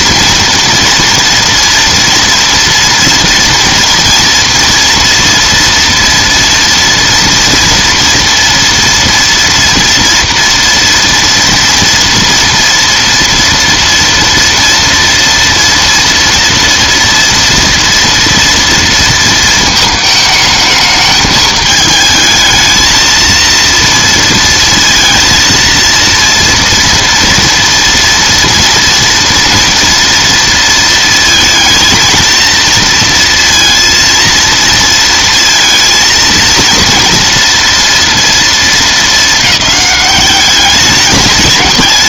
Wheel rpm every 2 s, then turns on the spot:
230, 240, 230, 230, 230, 230, 230, 230, 230, 230, 220, 220, 230, 230, 230, 230, 230, 230, 230, 230, 200.
none